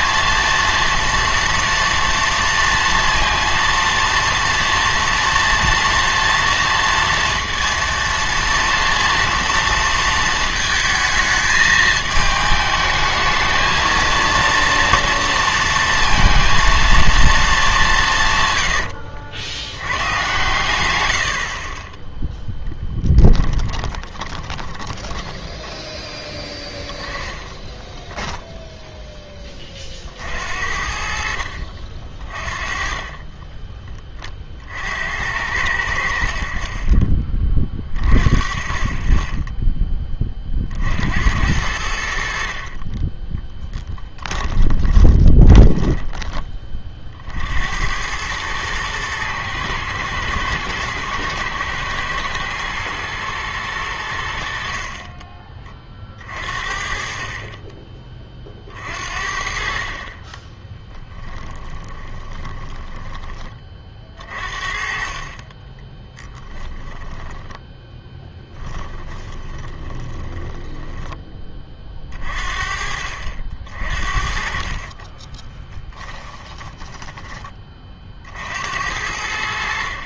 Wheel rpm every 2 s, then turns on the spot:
230, 230, 230, 230, 230, 220, 220, 230, 230, 110, 120, 10, 20, 10, 0, 60, 30, 60, 30, 20, 50, 30, 20, 30, 110, 110, 110, 50, 40, 50, 20, 20, 40, 10, 10, 20, 50, 30, 20, 70.
22-26 44-46 60-72 74-78